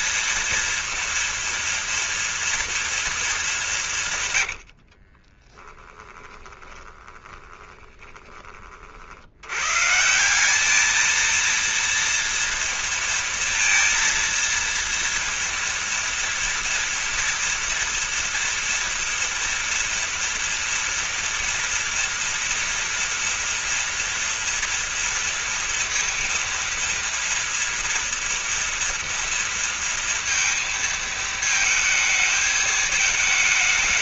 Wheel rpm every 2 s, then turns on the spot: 230, 230, 90, 20, 40, 210, 230, 230, 230, 240, 230, 240, 230, 230, 230, 230, 220.
4-8